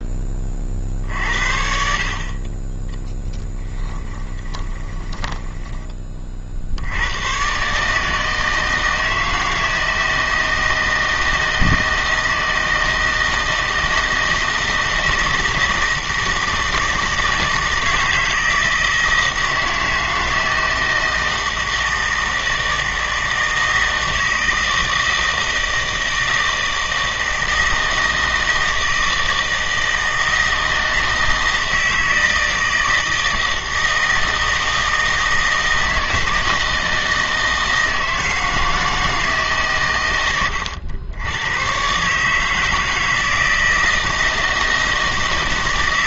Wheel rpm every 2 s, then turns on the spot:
50, 20, 20, 60, 160, 160, 160, 160, 160, 160, 160, 160, 160, 160, 160, 160, 160, 160, 160, 160, 100, 160, 160.
4-6